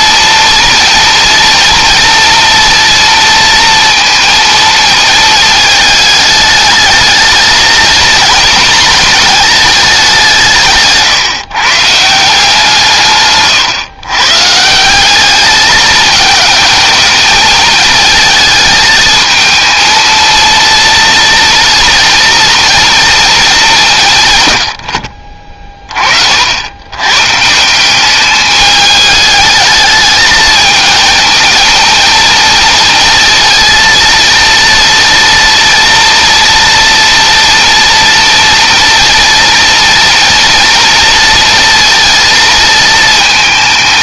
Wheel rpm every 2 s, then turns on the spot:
230, 230, 220, 210, 220, 150, 160, 150, 220, 220, 230, 230, 110, 80, 210, 220, 230, 230, 230, 230, 230, 220.
none